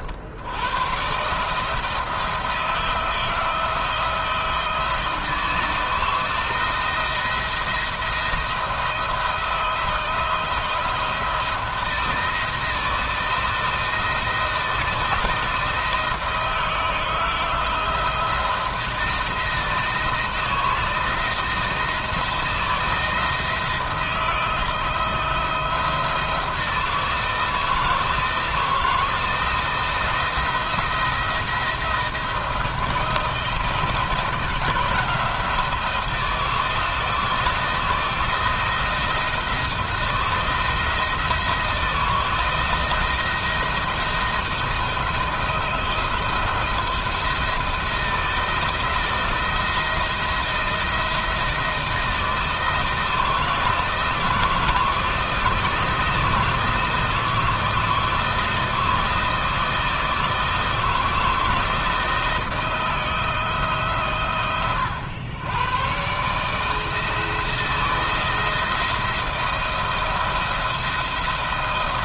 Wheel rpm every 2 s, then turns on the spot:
100, 170, 160, 170, 170, 170, 170, 160, 160, 170, 160, 170, 170, 170, 160, 170, 160, 170, 170, 170, 170, 160, 170, 170, 170, 170, 160, 170, 160, 160, 160, 160, 110, 160, 170, 170.
none